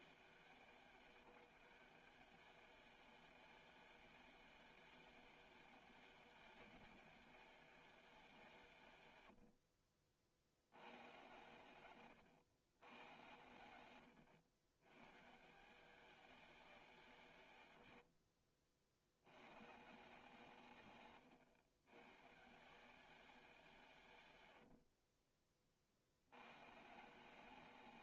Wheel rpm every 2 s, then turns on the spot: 150, 190, 200, 200, 150, 70, 110, 100, 190, 60, 140, 160, 60, 110.
24-26